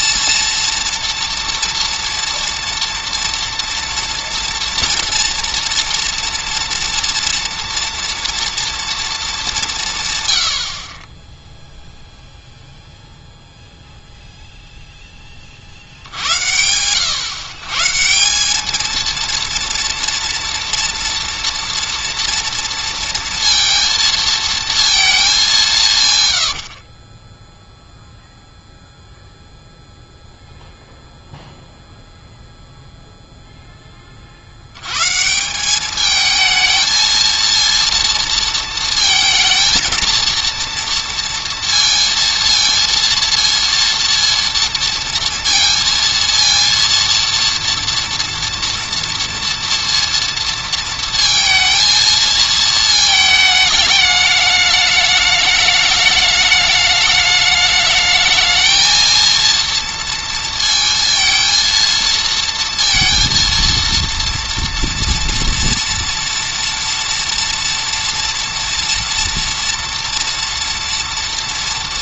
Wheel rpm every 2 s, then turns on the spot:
230, 230, 230, 230, 230, 70, 0, 0, 90, 210, 230, 240, 230, 70, 0, 0, 0, 80, 220, 230, 230, 230, 230, 230, 230, 230, 230, 210, 210, 220, 230, 230, 230, 230, 230, 230.
none